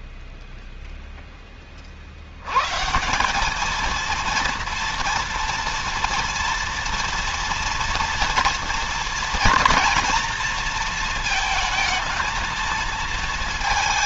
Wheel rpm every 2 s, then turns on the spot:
0, 160, 230, 240, 230, 220, 220.
none